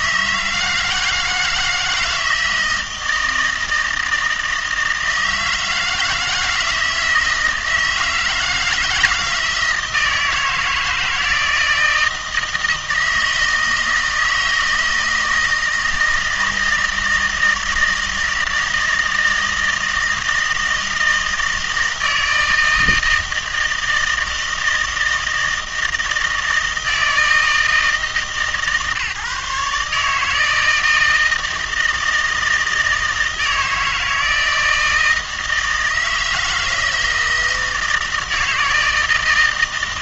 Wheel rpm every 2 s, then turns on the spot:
160, 160, 160, 160, 160, 160, 160, 160, 160, 160, 160, 160, 160, 160, 150, 160, 160, 160, 160, 160.
none